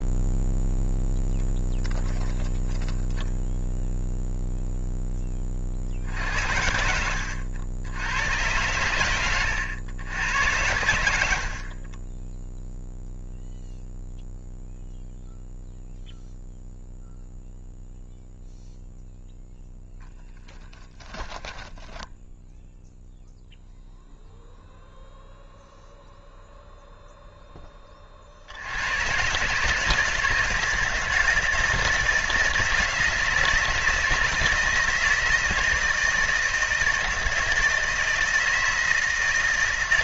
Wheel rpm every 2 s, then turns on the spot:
0, 10, 0, 70, 100, 100, 0, 0, 0, 0, 20, 0, 0, 0, 80, 160, 160, 160, 160, 160.
6-8 10-12 20-22